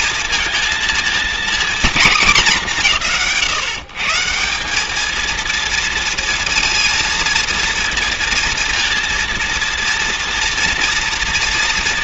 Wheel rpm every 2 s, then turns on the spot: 220, 200, 190, 230, 230, 230.
none